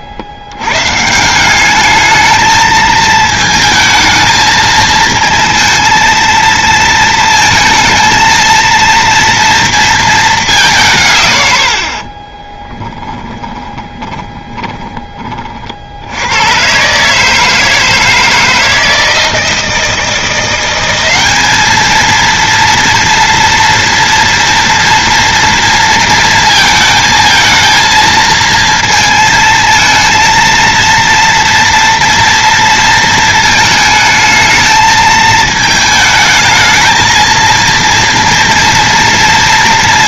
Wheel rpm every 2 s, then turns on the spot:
120, 220, 220, 230, 230, 170, 10, 30, 130, 160, 180, 230, 230, 220, 220, 230, 230, 220, 220, 230.
12-16